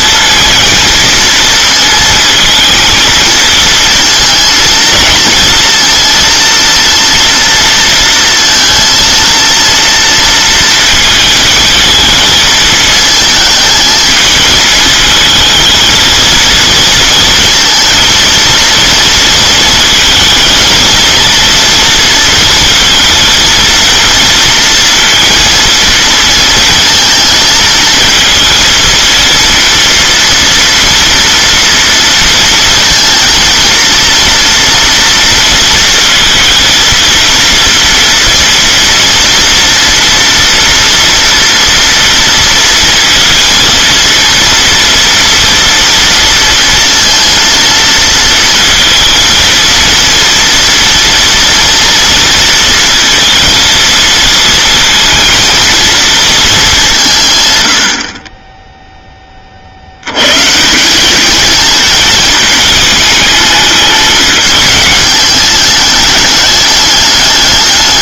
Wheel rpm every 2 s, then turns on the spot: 230, 220, 230, 240, 230, 230, 220, 220, 230, 230, 230, 230, 230, 230, 230, 230, 230, 230, 230, 230, 230, 230, 230, 230, 230, 230, 230, 230, 200, 10, 180, 220, 210, 210.
none